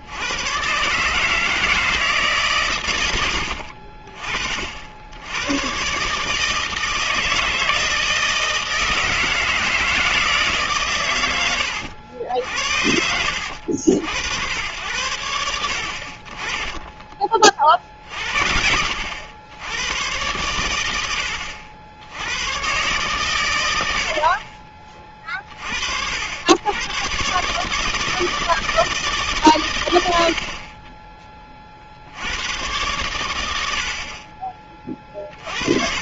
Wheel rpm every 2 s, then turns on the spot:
110, 140, 60, 160, 160, 140, 70, 90, 20, 70, 110, 120, 40, 100, 160, 30, 100, 30.
none